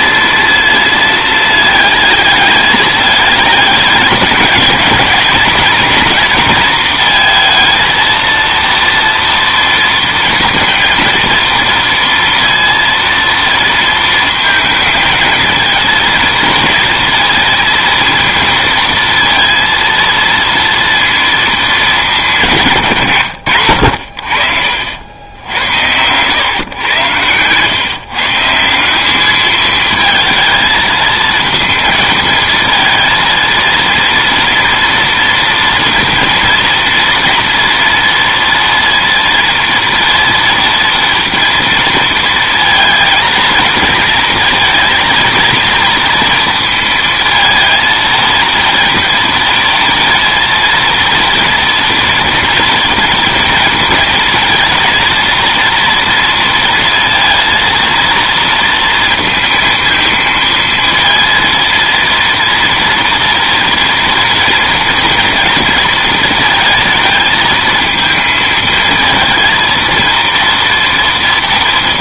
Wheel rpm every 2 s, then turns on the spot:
230, 210, 210, 230, 230, 230, 230, 230, 230, 230, 230, 170, 60, 120, 170, 220, 230, 230, 230, 230, 230, 230, 230, 230, 230, 230, 230, 230, 230, 230, 230, 230, 230, 230, 230, 240.
24-26